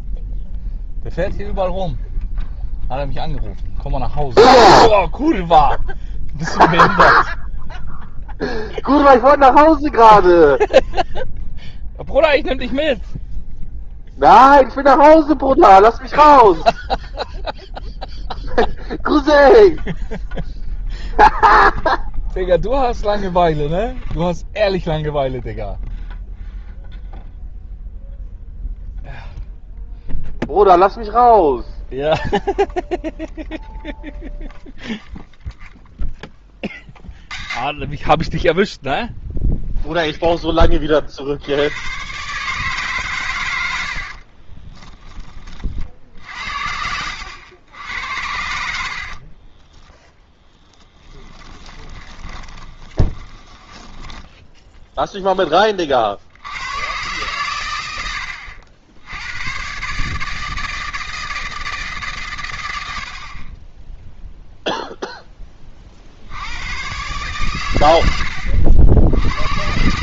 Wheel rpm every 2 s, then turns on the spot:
0, 0, 0, 0, 0, 0, 0, 0, 0, 0, 0, 0, 0, 0, 0, 0, 0, 0, 20, 0, 30, 140, 20, 80, 70, 10, 20, 10, 110, 80, 160, 100, 0, 110, 70.
44-54